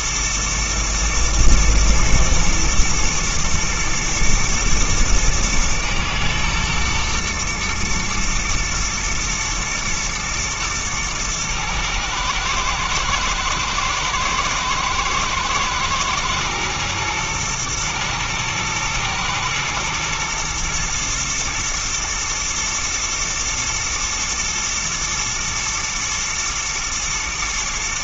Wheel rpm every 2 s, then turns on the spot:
110, 110, 110, 120, 120, 110, 110, 110, 110, 110, 120, 120, 120, 120.
none